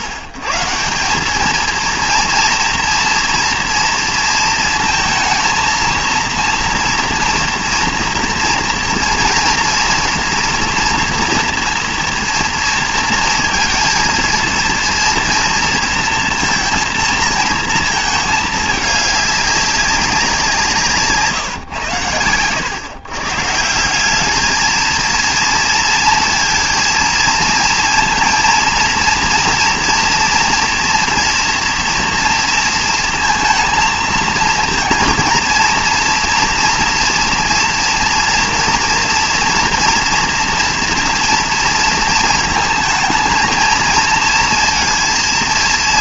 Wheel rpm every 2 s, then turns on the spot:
140, 230, 230, 230, 230, 230, 230, 230, 230, 210, 170, 110, 220, 230, 230, 230, 230, 230, 230, 230, 230, 220, 230.
none